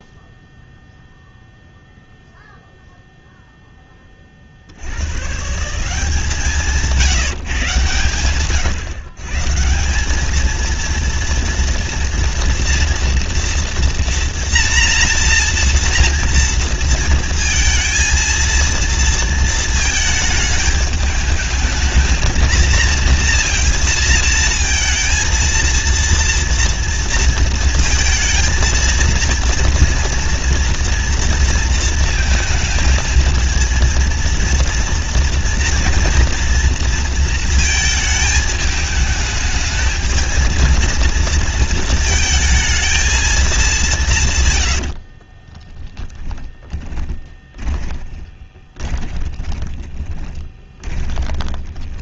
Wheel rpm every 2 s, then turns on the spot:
0, 0, 70, 170, 130, 230, 230, 230, 230, 230, 220, 230, 230, 230, 230, 230, 220, 230, 230, 220, 230, 220, 90, 20, 20, 20.
44-52